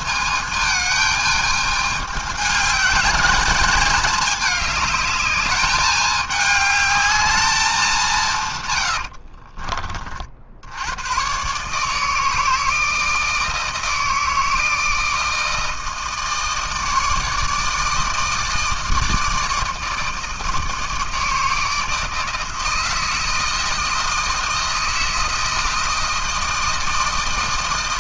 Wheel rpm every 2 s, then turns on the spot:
220, 210, 210, 210, 130, 70, 160, 160, 160, 160, 160, 160, 160, 160.
8-10